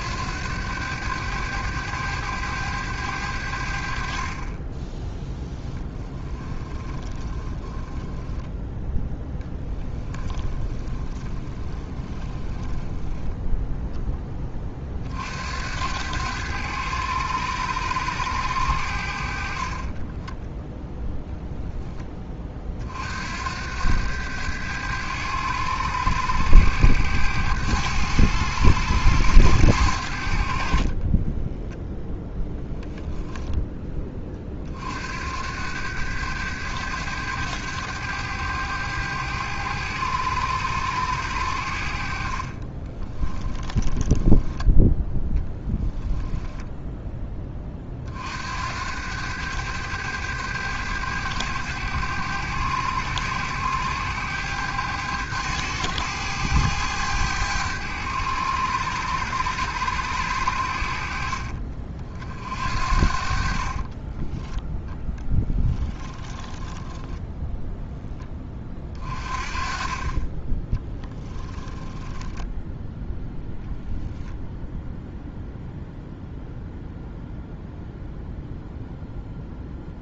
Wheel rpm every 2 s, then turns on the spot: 100, 100, 20, 20, 0, 20, 10, 40, 100, 70, 0, 50, 100, 100, 100, 40, 0, 50, 100, 100, 100, 20, 10, 10, 90, 100, 100, 100, 100, 100, 60, 50, 10, 10, 30, 10, 0, 0, 0, 0.
6-8 10-14 30-32 42-44 66-68 70-72